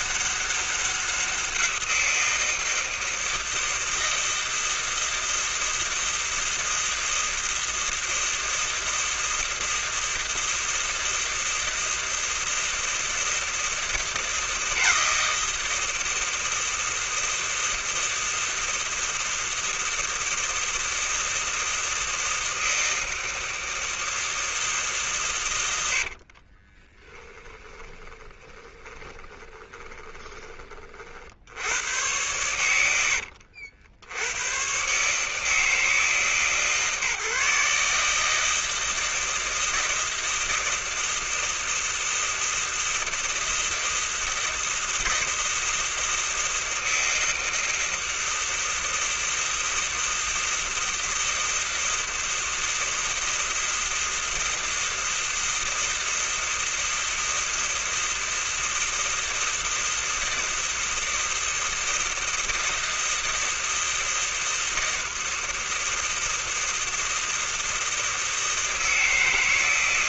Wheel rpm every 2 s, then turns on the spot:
200, 170, 160, 160, 160, 160, 160, 160, 160, 160, 160, 160, 160, 70, 20, 20, 100, 90, 150, 150, 160, 160, 160, 160, 160, 160, 160, 160, 160, 160, 160, 160, 160, 160, 160.
26-32